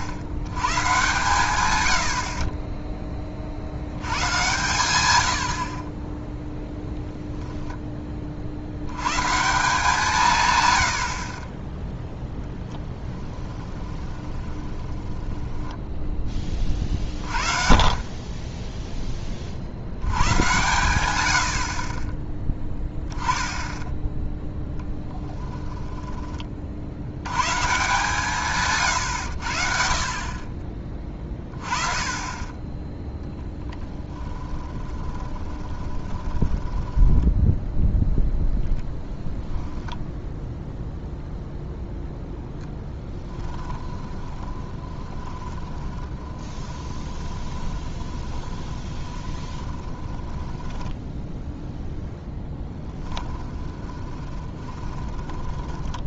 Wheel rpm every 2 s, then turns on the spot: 100, 10, 120, 0, 70, 110, 10, 20, 30, 10, 110, 10, 10, 60, 140, 30, 20, 20, 10, 10, 0, 10, 20, 20, 20, 10, 10, 20.
14-16 34-38 44-56